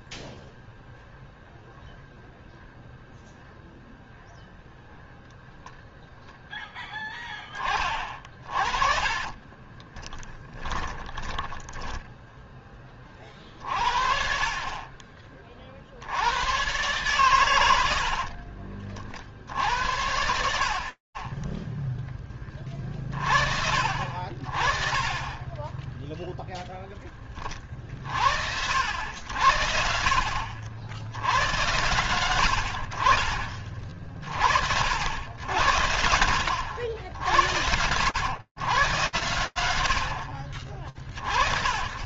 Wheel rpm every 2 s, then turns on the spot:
0, 0, 0, 0, 40, 20, 10, 50, 90, 60, 80, 30, 40, 0, 60, 60, 90, 60, 80, 110, 40.
8-12 18-20